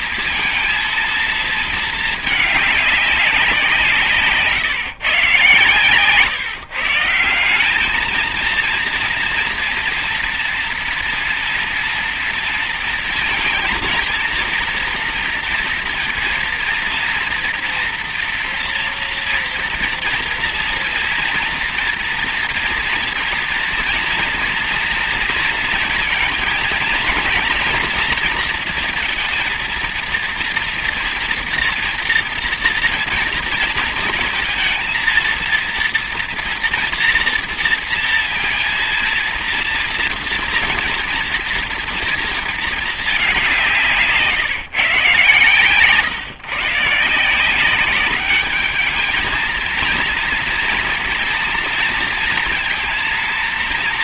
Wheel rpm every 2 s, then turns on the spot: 230, 200, 130, 170, 240, 240, 230, 230, 230, 230, 240, 230, 230, 230, 230, 240, 230, 230, 230, 230, 240, 210, 150, 170, 210, 230, 230.
none